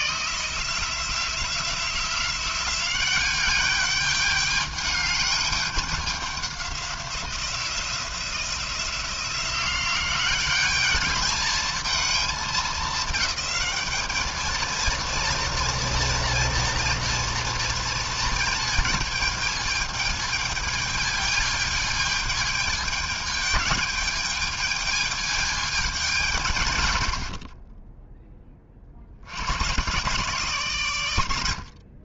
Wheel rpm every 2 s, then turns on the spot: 150, 180, 210, 190, 170, 190, 210, 220, 230, 230, 220, 220, 220, 160, 20, 130.
none